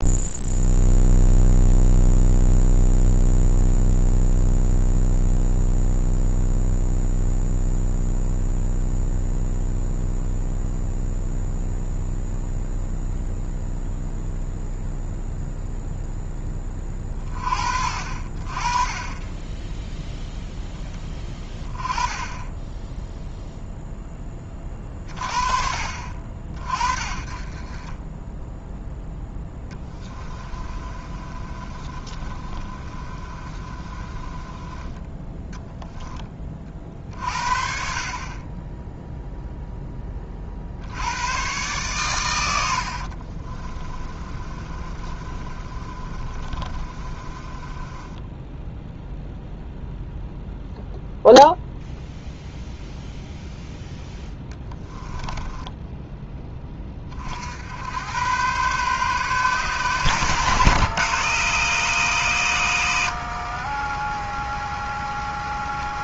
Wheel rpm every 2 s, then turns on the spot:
0, 0, 0, 0, 0, 0, 0, 0, 20, 30, 10, 10, 10, 50, 10, 30, 30, 20, 30, 20, 50, 90, 30, 30, 10, 0, 0, 10, 20, 130, 130, 110, 0.
30-36 42-50 54-56